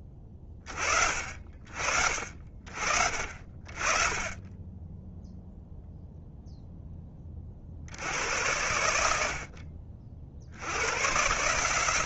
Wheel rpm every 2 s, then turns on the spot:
20, 40, 20, 10, 90, 90.
none